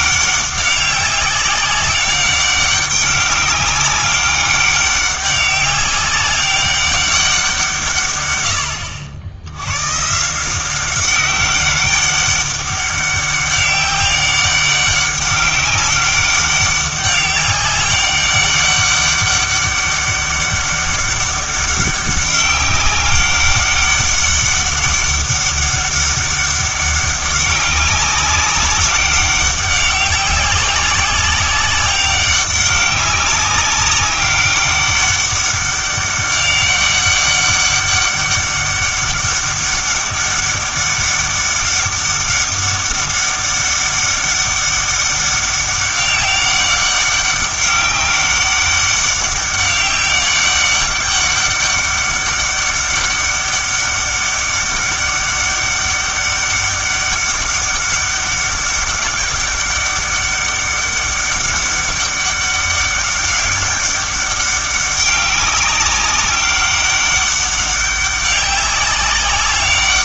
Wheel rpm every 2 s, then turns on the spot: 190, 190, 200, 200, 90, 180, 200, 200, 200, 200, 200, 200, 200, 200, 200, 190, 190, 200, 200, 200, 200, 200, 200, 190, 200, 200, 200, 200, 200, 200, 200, 200, 200, 200, 200.
none